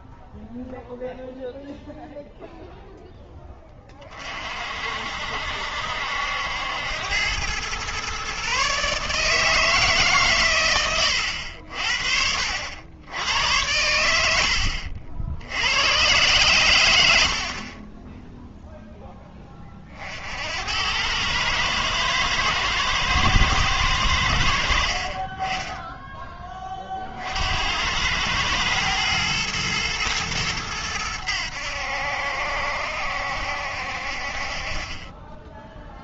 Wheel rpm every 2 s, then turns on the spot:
0, 0, 50, 80, 140, 120, 70, 70, 120, 0, 80, 110, 60, 30, 110, 110, 70, 60.
14-16